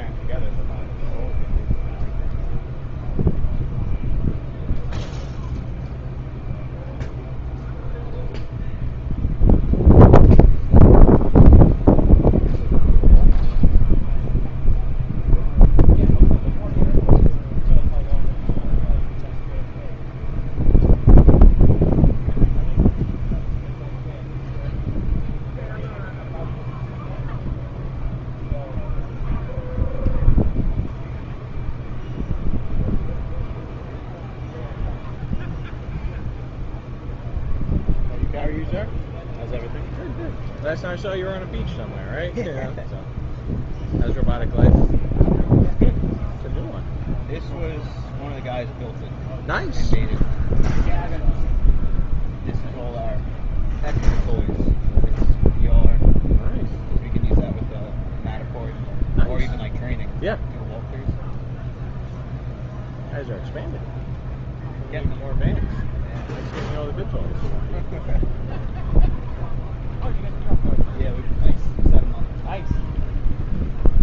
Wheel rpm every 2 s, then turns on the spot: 0, 0, 0, 0, 0, 0, 0, 0, 0, 0, 0, 0, 0, 0, 0, 0, 0, 0, 0, 0, 0, 0, 0, 0, 0, 0, 0, 0, 0, 0, 0, 0, 0, 0, 0, 0, 0.
none